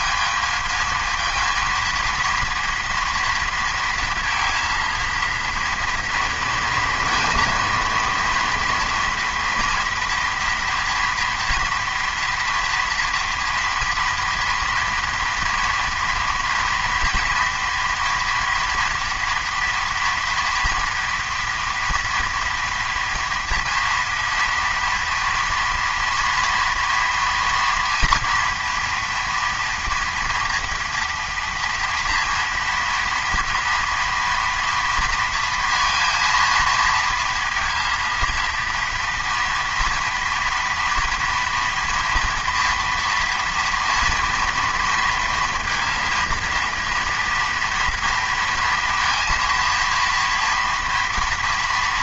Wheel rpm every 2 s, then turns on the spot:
220, 230, 230, 230, 230, 240, 240, 230, 230, 230, 230, 230, 230, 230, 240, 240, 230, 230, 230, 230, 240, 230, 230, 230, 230, 230.
none